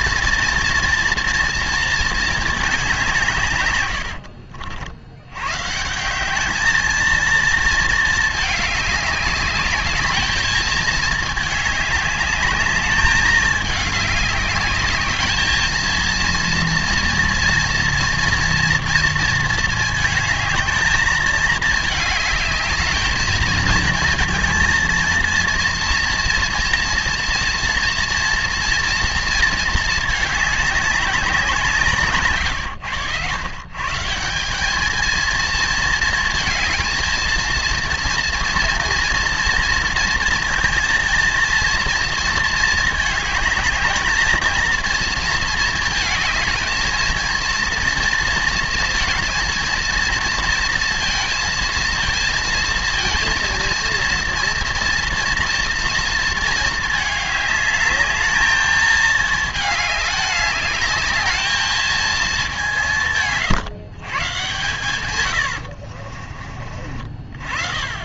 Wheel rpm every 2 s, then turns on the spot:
230, 210, 60, 220, 210, 220, 210, 200, 230, 230, 220, 210, 230, 230, 230, 210, 110, 200, 230, 230, 230, 220, 230, 220, 230, 240, 230, 230, 220, 220, 200, 190, 120, 40.
none